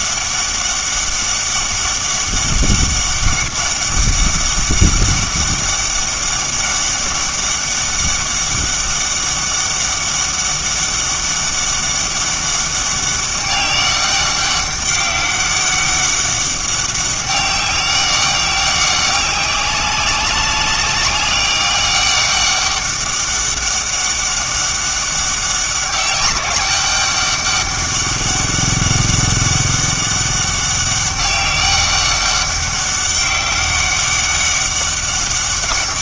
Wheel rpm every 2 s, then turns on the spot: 200, 200, 200, 200, 200, 200, 200, 200, 200, 190, 190, 200, 200, 200, 200, 200, 200, 200.
none